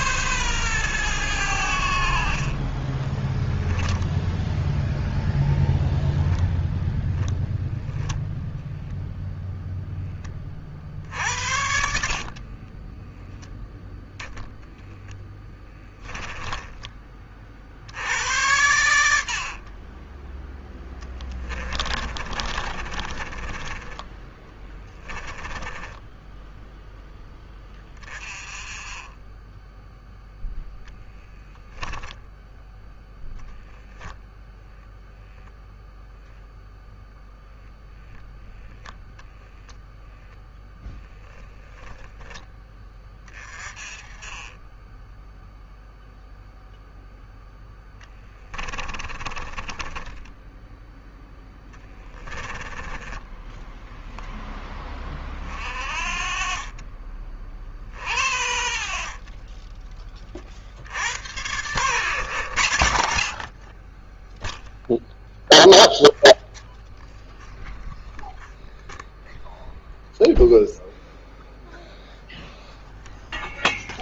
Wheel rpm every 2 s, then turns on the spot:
110, 20, 0, 0, 0, 40, 20, 20, 20, 90, 10, 30, 10, 10, 20, 0, 0, 0, 0, 0, 0, 10, 10, 0, 20, 10, 10, 20, 30, 40, 70, 70, 0, 0, 0, 0, 0.
2-4 10-14 20-26 48-50